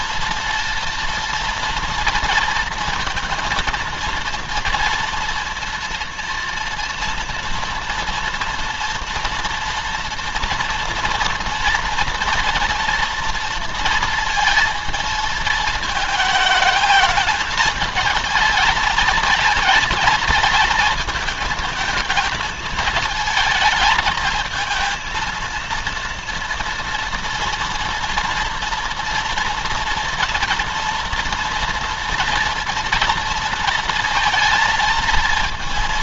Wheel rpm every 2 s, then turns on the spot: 230, 230, 230, 230, 230, 230, 240, 230, 220, 220, 220, 220, 220, 230, 230, 240, 240, 230.
none